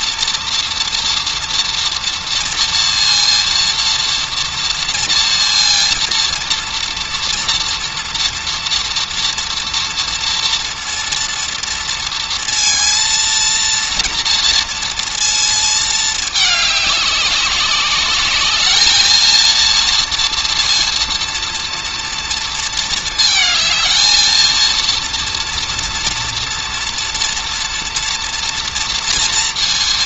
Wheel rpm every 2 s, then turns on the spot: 230, 230, 230, 230, 240, 230, 230, 230, 210, 210, 230, 230, 230, 240, 230.
none